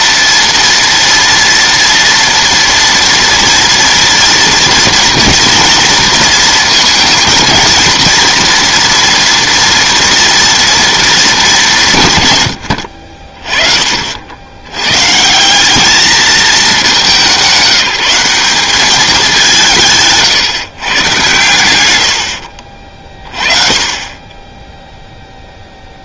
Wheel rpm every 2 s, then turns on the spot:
230, 230, 240, 230, 230, 230, 90, 100, 210, 200, 140, 50, 10.
none